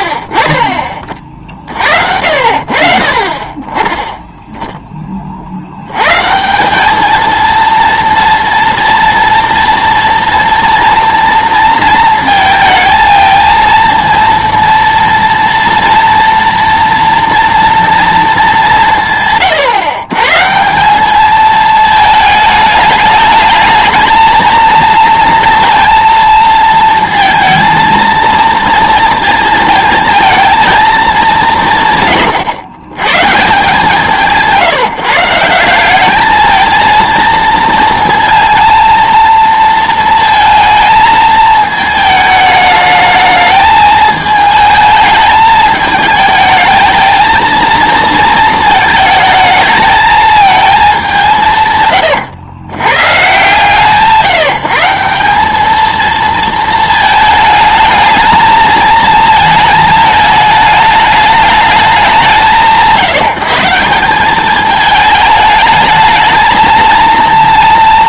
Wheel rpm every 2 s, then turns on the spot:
40, 40, 10, 200, 240, 230, 220, 230, 230, 190, 160, 210, 230, 230, 230, 220, 120, 150, 220, 230, 220, 220, 220, 220, 220, 210, 120, 170, 220, 220, 220, 170, 210, 230.
none